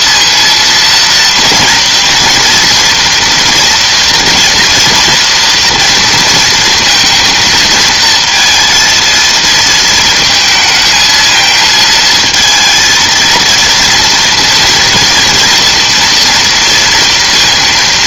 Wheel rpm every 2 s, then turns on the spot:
230, 230, 230, 230, 230, 220, 220, 230, 230.
none